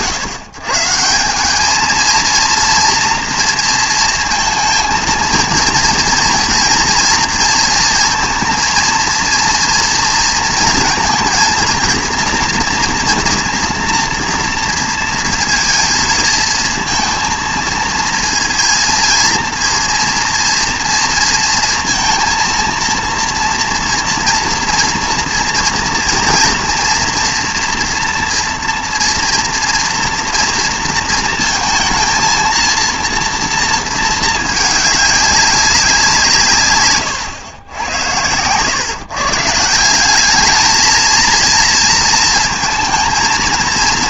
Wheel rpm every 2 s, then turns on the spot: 110, 230, 230, 240, 230, 230, 230, 230, 230, 230, 230, 230, 230, 230, 240, 230, 230, 210, 130, 120, 220, 220.
none